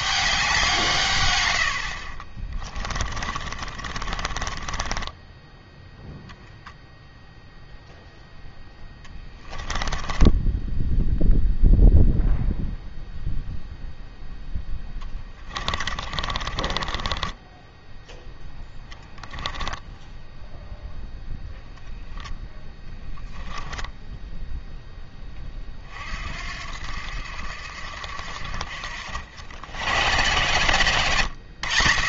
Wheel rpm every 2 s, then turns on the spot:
170, 30, 20, 0, 10, 10, 0, 10, 30, 0, 0, 10, 0, 70, 60, 110.
2-6 8-12 14-18 22-24